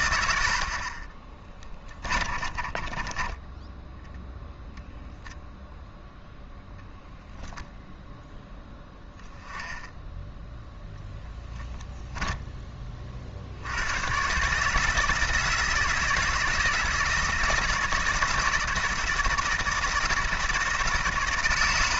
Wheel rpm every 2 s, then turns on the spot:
60, 30, 0, 0, 0, 0, 20, 150, 160, 160, 170.
2-4